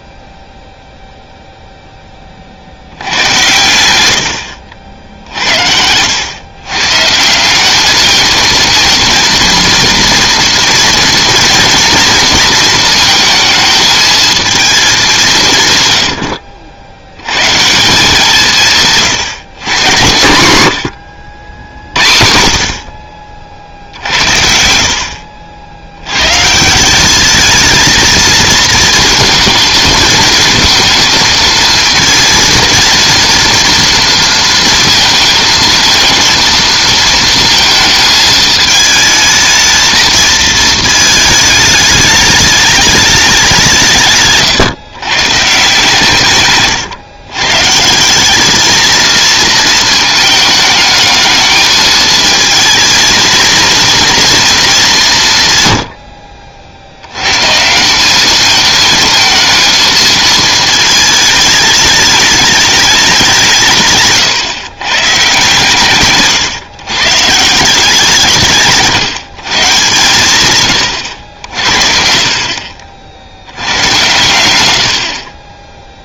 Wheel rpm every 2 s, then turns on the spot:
0, 70, 70, 130, 220, 230, 230, 210, 60, 160, 100, 50, 60, 180, 220, 230, 230, 230, 230, 220, 220, 210, 140, 140, 220, 220, 220, 210, 70, 220, 220, 210, 140, 140, 150, 110, 50, 90.
74-76